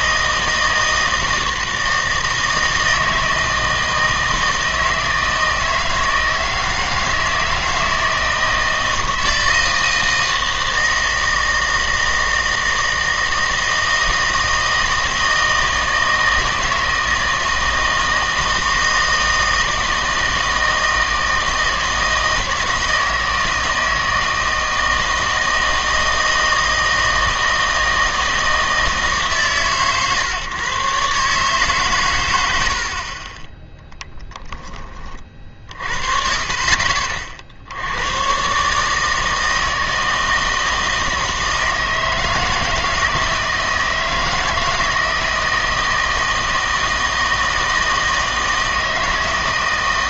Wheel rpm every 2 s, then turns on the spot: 160, 160, 160, 160, 160, 160, 160, 160, 160, 160, 160, 160, 160, 160, 160, 140, 80, 20, 50, 140, 160, 160, 160, 160, 160.
none